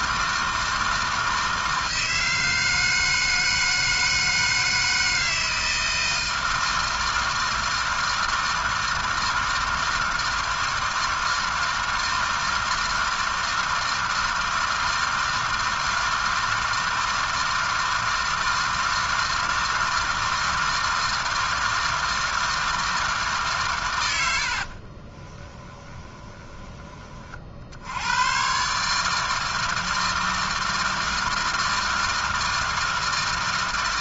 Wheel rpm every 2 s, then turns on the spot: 160, 160, 160, 160, 160, 160, 160, 160, 160, 160, 160, 160, 50, 20, 130, 160, 160.
24-28